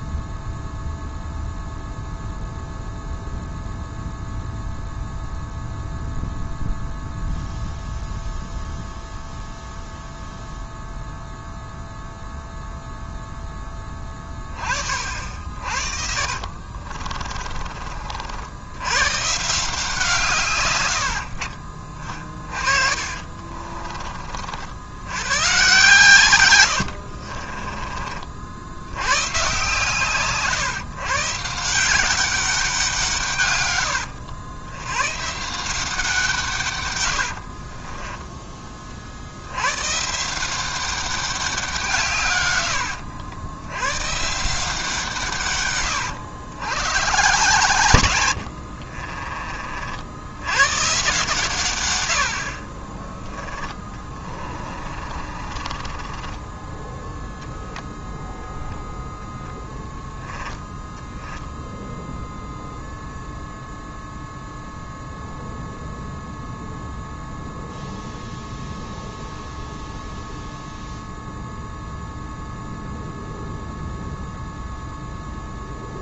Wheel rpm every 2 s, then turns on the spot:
0, 0, 0, 0, 0, 0, 0, 30, 40, 90, 120, 40, 60, 90, 70, 140, 190, 100, 130, 20, 180, 110, 170, 120, 70, 110, 40, 30, 10, 0, 10, 0, 0, 0, 0, 0, 0, 0.
16-18 22-24 26-28 48-50 54-58